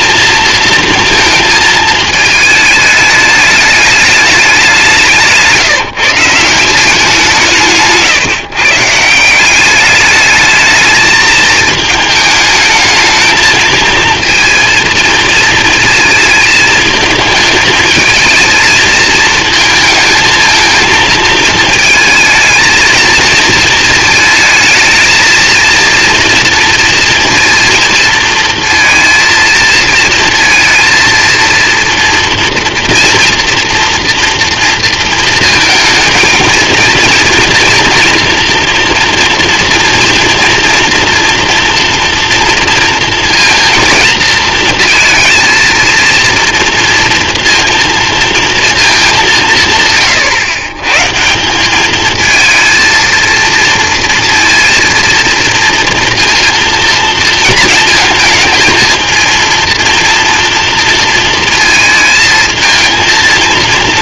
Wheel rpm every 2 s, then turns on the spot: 230, 210, 190, 180, 140, 210, 220, 230, 220, 220, 220, 230, 220, 230, 230, 230, 230, 230, 230, 230, 240, 230, 220, 230, 220, 120, 230, 230, 230, 230, 230, 230.
none